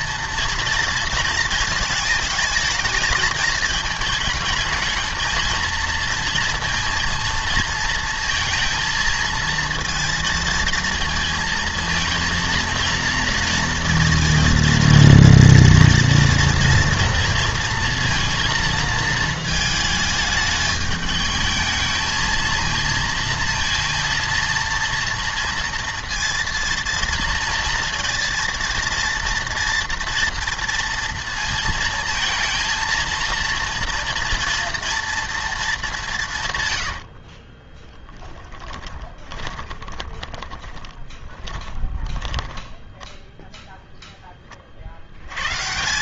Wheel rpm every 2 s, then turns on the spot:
230, 220, 220, 230, 230, 230, 230, 230, 230, 230, 210, 230, 230, 230, 230, 230, 220, 230, 110, 20, 20, 10, 40.
38-44